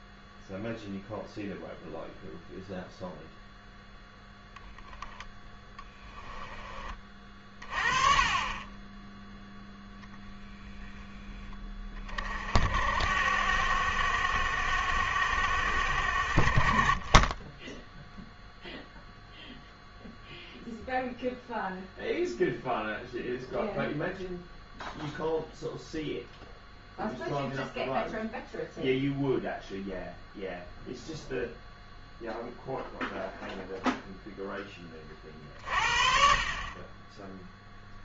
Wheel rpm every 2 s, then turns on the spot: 0, 0, 0, 20, 20, 10, 60, 70, 40, 0, 0, 0, 0, 0, 0, 0, 0, 20, 30.
none